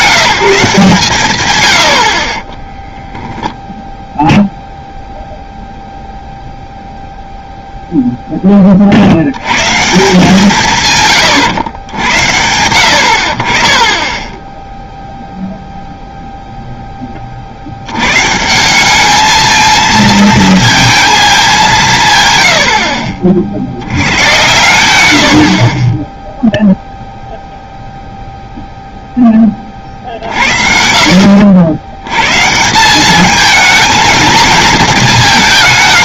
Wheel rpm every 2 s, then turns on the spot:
160, 10, 0, 0, 20, 160, 80, 10, 0, 170, 230, 100, 100, 0, 0, 50, 160, 220.
2-4